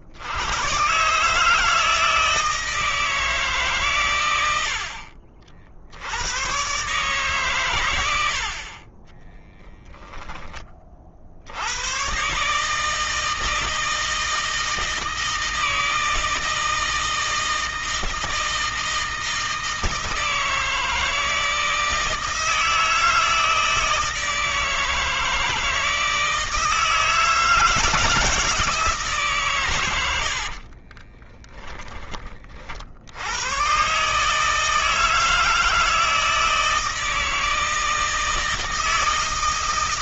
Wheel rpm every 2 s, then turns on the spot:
140, 160, 60, 140, 20, 50, 160, 160, 160, 160, 160, 160, 160, 160, 150, 20, 70, 160, 160, 160.
30-32